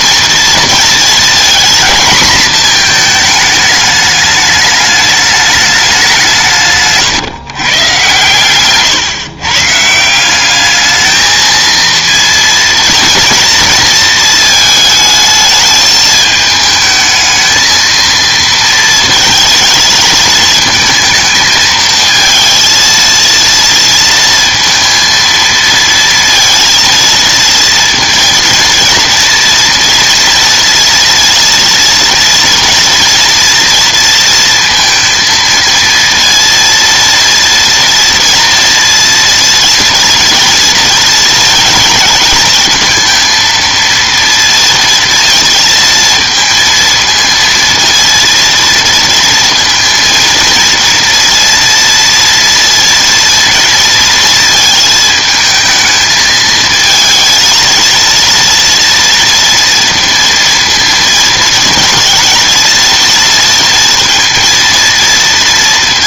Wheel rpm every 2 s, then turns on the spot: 230, 230, 210, 140, 120, 210, 230, 220, 220, 230, 220, 230, 230, 230, 230, 230, 230, 230, 230, 230, 230, 220, 230, 230, 230, 230, 230, 230, 220, 230, 230, 230, 230.
6-8